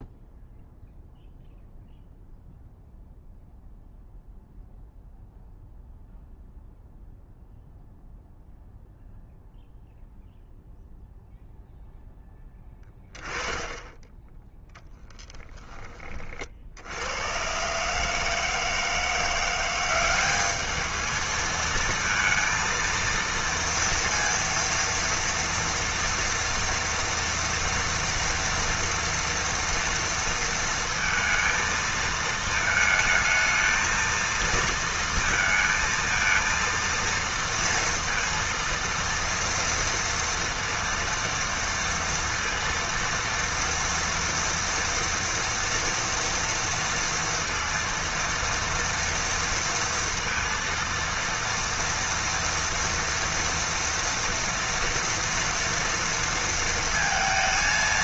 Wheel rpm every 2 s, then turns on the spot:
0, 0, 0, 0, 0, 0, 10, 0, 70, 160, 210, 230, 230, 230, 240, 230, 220, 230, 230, 230, 230, 230, 230, 230, 230, 230, 230, 230, 230.
none